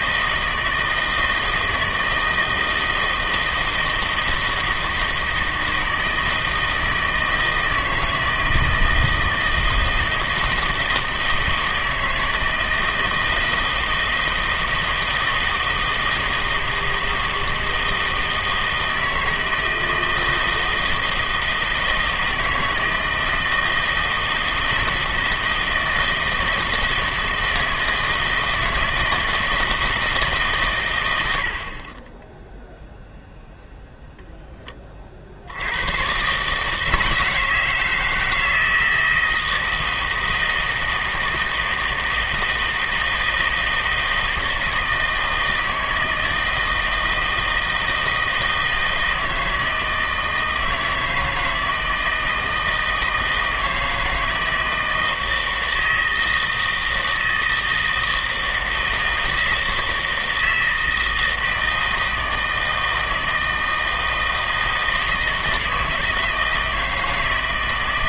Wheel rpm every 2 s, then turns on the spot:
160, 160, 160, 160, 160, 160, 160, 160, 160, 160, 160, 160, 160, 160, 160, 130, 0, 20, 150, 160, 160, 160, 160, 160, 160, 160, 160, 160, 160, 160, 160, 160, 160, 160.
none